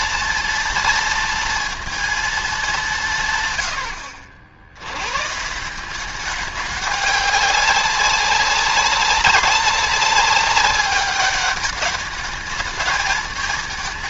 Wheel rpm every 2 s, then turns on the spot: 230, 200, 70, 200, 190, 200, 210.
none